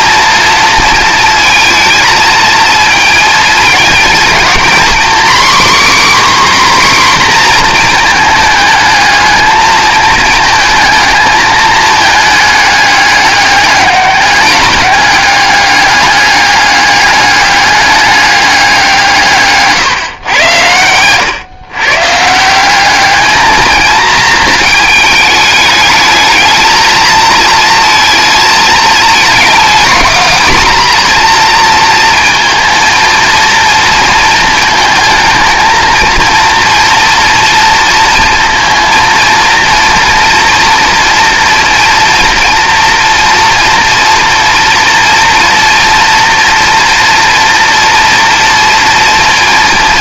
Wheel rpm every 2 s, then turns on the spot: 230, 220, 250, 270, 220, 220, 210, 200, 200, 190, 110, 180, 220, 220, 220, 240, 230, 230, 240, 230, 230, 230, 230, 240, 230.
none